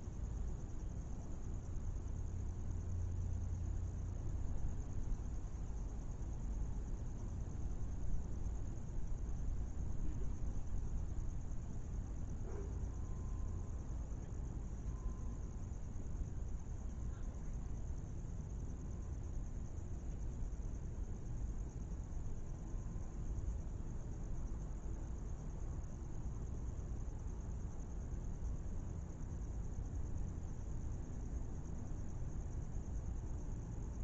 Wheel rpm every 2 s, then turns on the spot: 0, 0, 0, 0, 0, 0, 0, 0, 0, 0, 0, 0, 0, 0, 0, 0, 0.
none